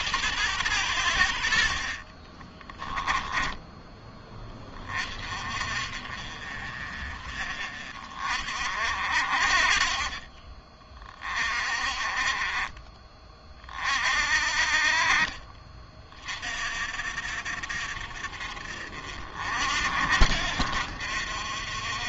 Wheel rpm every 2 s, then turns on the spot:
90, 20, 30, 40, 50, 30, 30, 50, 50, 50, 60.
2-4